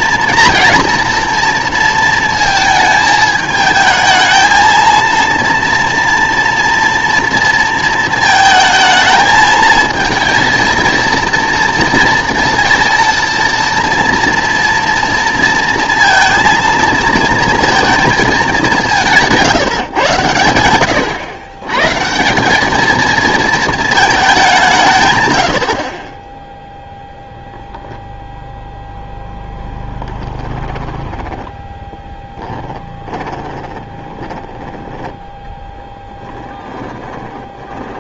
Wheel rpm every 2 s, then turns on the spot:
230, 220, 220, 230, 220, 230, 230, 230, 220, 180, 120, 210, 180, 0, 0, 10, 20, 10, 20.
30-34 36-38